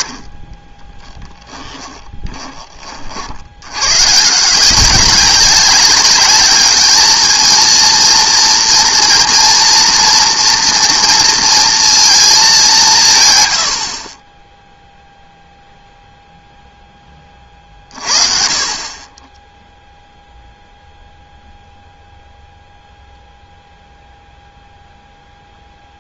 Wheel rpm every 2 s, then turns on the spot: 30, 20, 170, 210, 240, 230, 200, 10, 0, 40, 0, 0, 0.
0-2